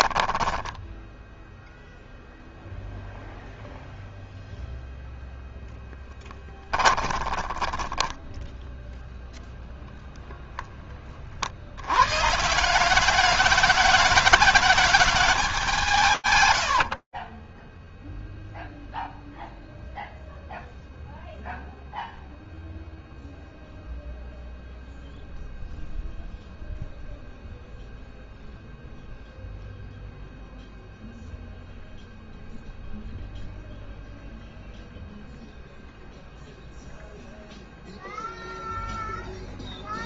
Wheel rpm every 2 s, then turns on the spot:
10, 0, 0, 10, 0, 10, 160, 210, 130, 0, 0, 0, 0, 0, 0, 0, 0, 0, 0, 0.
0-2 6-8 16-18